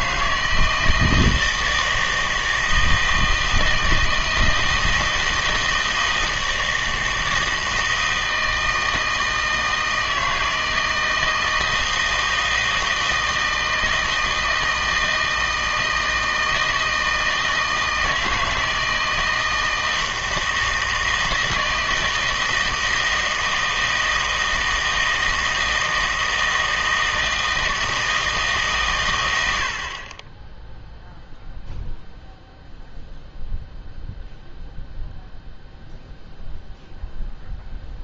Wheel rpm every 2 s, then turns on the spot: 160, 160, 160, 160, 160, 160, 160, 160, 160, 160, 160, 160, 160, 160, 140, 20, 0, 0, 0.
none